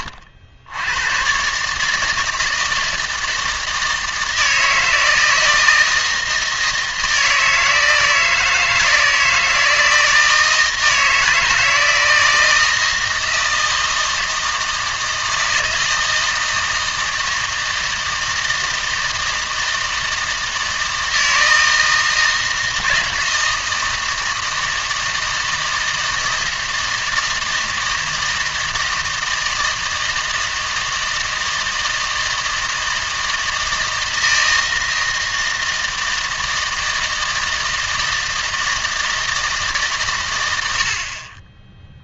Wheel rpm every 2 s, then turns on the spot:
70, 160, 160, 160, 160, 160, 160, 160, 160, 160, 160, 160, 160, 160, 160, 160, 160, 160, 160, 160, 90.
none